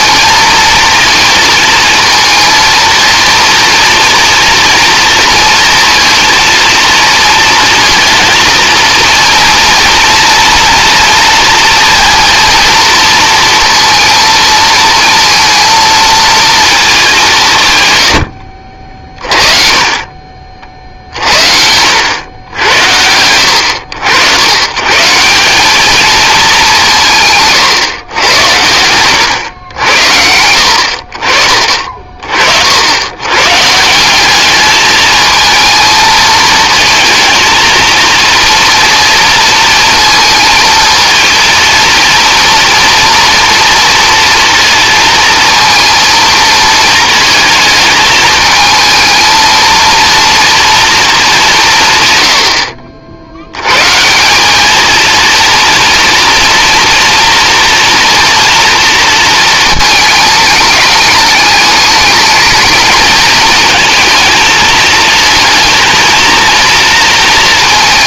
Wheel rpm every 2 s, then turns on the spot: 230, 230, 230, 230, 230, 230, 230, 230, 220, 60, 50, 80, 120, 190, 100, 70, 60, 210, 220, 230, 230, 240, 230, 230, 220, 230, 70, 220, 240, 230, 210, 220, 230, 230.
none